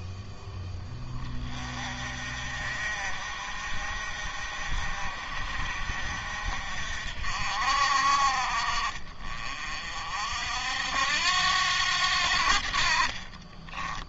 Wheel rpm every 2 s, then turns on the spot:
20, 50, 50, 50, 40, 70, 50.
12-14